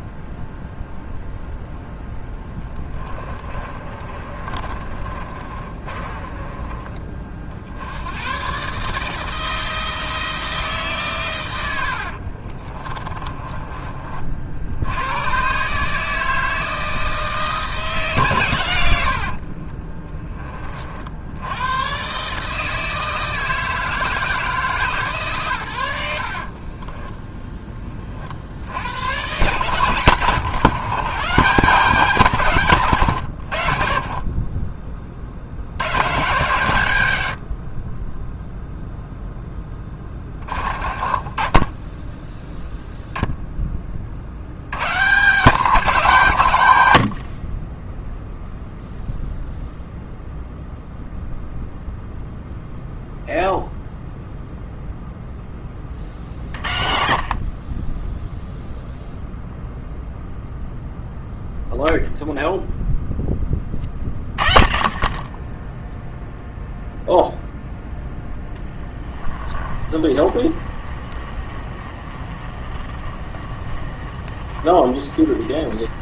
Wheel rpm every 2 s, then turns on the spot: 0, 20, 30, 30, 150, 150, 30, 90, 160, 100, 50, 160, 150, 10, 80, 140, 130, 30, 100, 0, 40, 0, 120, 90, 0, 0, 0, 0, 40, 0, 0, 0, 30, 0, 30, 30, 30, 30.
2-6 12-14 18-20 26-28 68-76